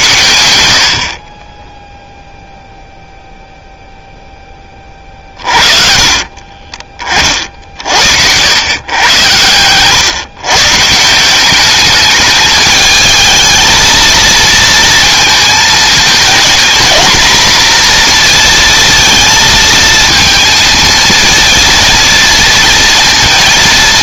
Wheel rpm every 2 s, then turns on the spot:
0, 0, 40, 50, 110, 190, 220, 220, 240, 220, 230, 230.
4-6